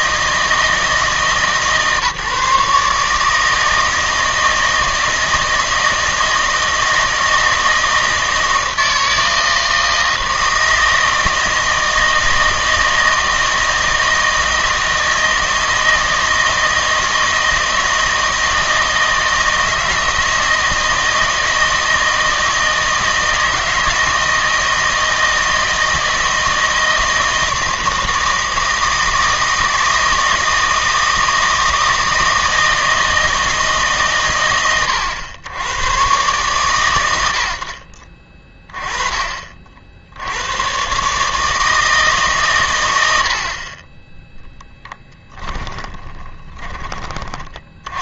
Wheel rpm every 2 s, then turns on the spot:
160, 150, 160, 160, 160, 160, 160, 160, 160, 160, 160, 160, 160, 160, 160, 160, 160, 110, 110, 20, 110, 120, 0, 20.
none